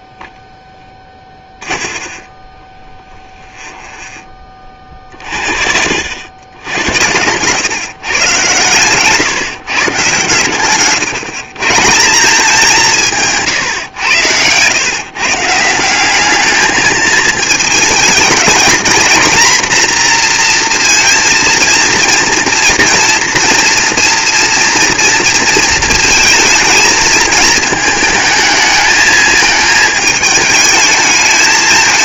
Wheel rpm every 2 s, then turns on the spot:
10, 20, 30, 100, 120, 130, 180, 130, 210, 230, 230, 230, 230, 220, 220, 220.
0-4 10-12